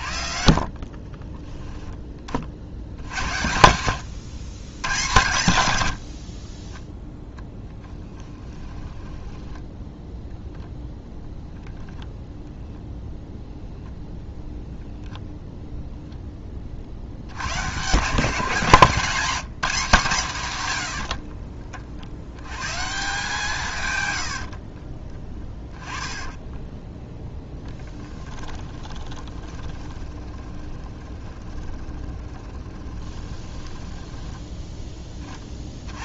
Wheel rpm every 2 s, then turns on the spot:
30, 70, 100, 10, 10, 0, 0, 0, 50, 160, 90, 140, 40, 20, 20, 20, 20, 10.
0-2 6-10 18-20 26-34